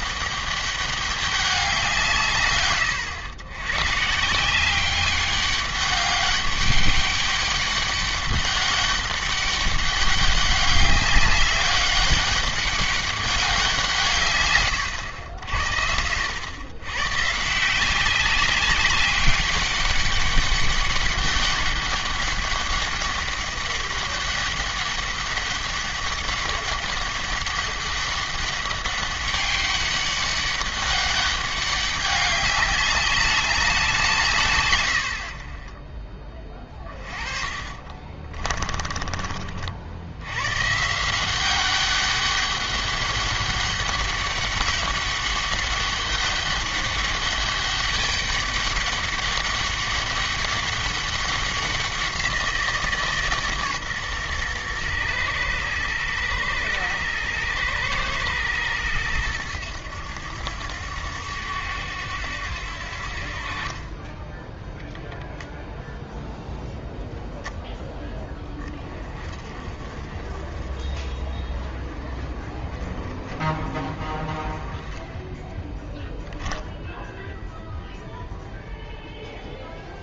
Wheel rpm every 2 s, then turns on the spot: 200, 120, 180, 200, 200, 200, 200, 110, 110, 190, 200, 200, 200, 200, 200, 200, 200, 110, 30, 30, 140, 200, 200, 200, 200, 200, 170, 120, 110, 110, 90, 80, 0, 0, 20, 40, 40, 20, 0, 0.
36-40